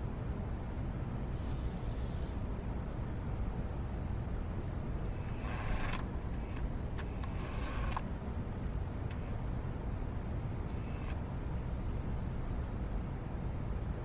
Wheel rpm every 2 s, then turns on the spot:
0, 0, 10, 10, 0, 0, 0.
6-8